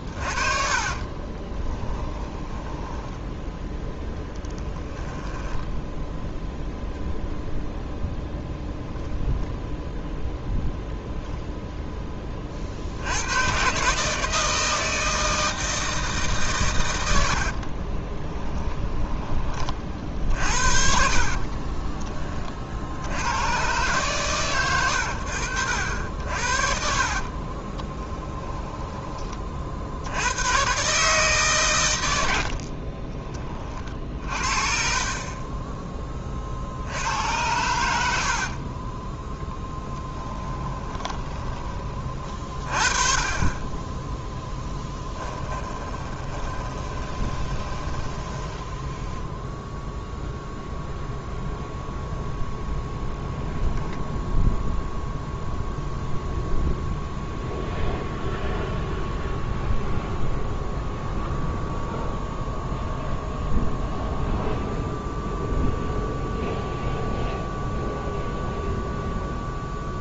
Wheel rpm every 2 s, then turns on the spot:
40, 10, 10, 0, 0, 0, 40, 160, 130, 10, 70, 60, 90, 60, 10, 120, 60, 50, 50, 40, 10, 30, 10, 20, 10, 0, 0, 0, 0, 0, 0, 0, 0, 0, 0.
0-6 18-20 28-30 32-34 38-42 46-50